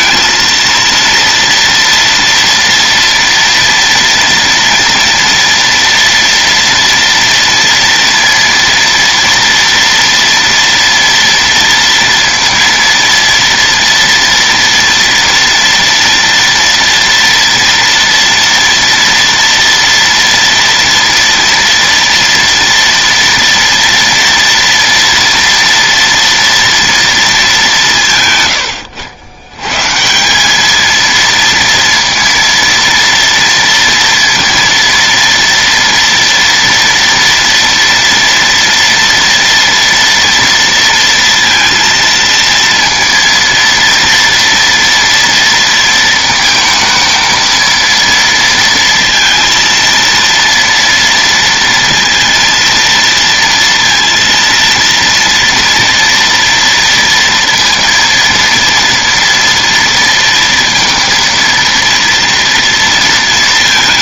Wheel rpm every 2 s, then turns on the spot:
230, 230, 240, 230, 230, 230, 230, 230, 230, 230, 230, 230, 230, 230, 120, 180, 230, 230, 230, 230, 230, 230, 230, 230, 230, 230, 230, 230, 230, 230, 230, 230.
none